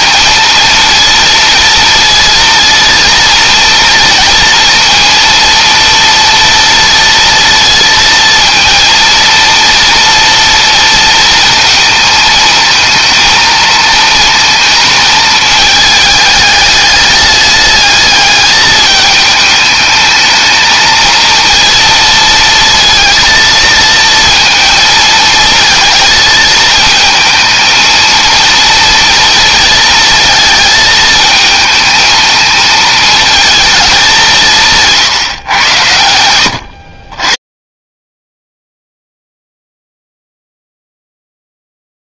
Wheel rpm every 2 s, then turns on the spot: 230, 230, 230, 230, 230, 230, 230, 220, 210, 210, 220, 230, 230, 220, 230, 220, 220, 150, 70, 0, 0.
34-36